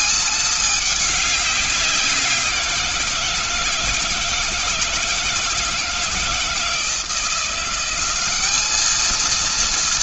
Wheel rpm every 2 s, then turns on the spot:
210, 170, 160, 160, 210.
none